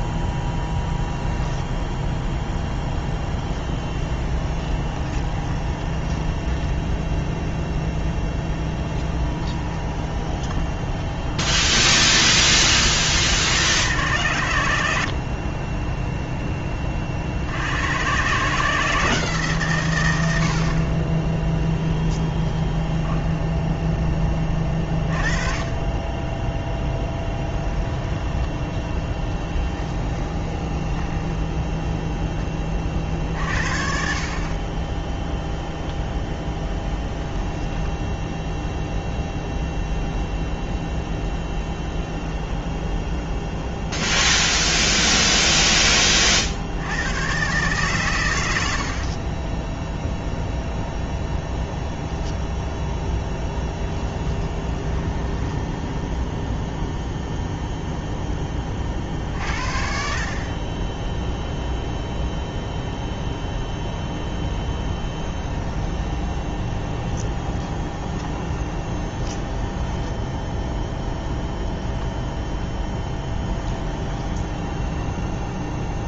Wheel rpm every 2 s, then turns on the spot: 0, 0, 20, 10, 10, 20, 20, 100, 10, 140, 70, 10, 20, 10, 10, 10, 10, 40, 0, 0, 0, 0, 0, 50, 100, 0, 0, 10, 10, 20, 30, 0, 0, 10, 20, 10, 0, 10.
4-12 22-24 28-32 54-58 66-70 74-76